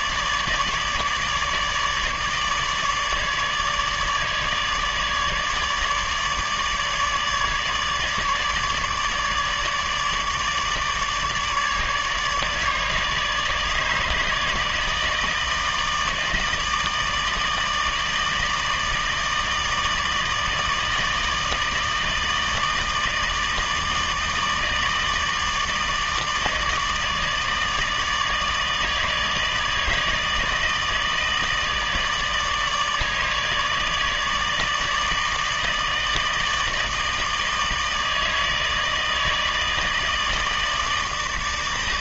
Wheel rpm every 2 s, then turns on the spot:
150, 150, 150, 150, 150, 150, 150, 150, 160, 160, 160, 160, 160, 160, 160, 160, 150, 150, 160, 160, 160.
none